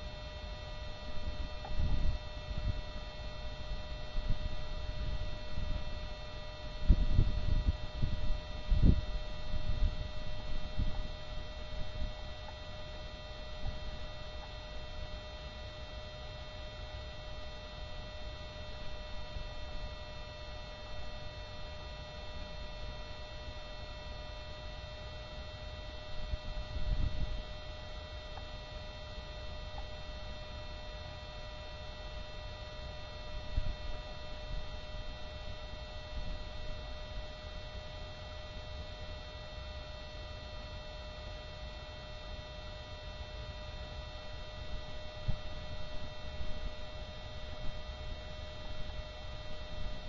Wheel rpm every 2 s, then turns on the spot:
0, 0, 0, 0, 0, 0, 0, 0, 0, 0, 0, 0, 0, 0, 0, 0, 0, 0, 0, 0, 0, 0, 0, 0, 0.
none